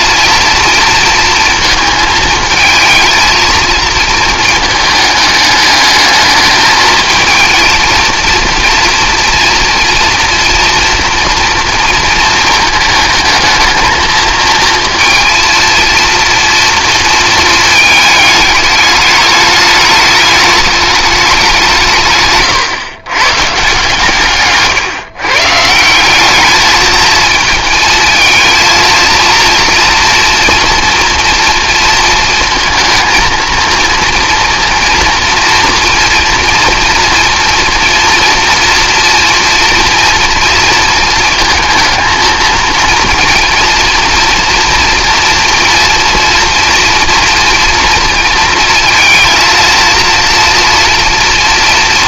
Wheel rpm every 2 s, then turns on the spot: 230, 220, 210, 220, 230, 230, 220, 230, 230, 210, 210, 130, 130, 220, 230, 230, 230, 230, 230, 230, 230, 220, 230, 230, 230, 240.
none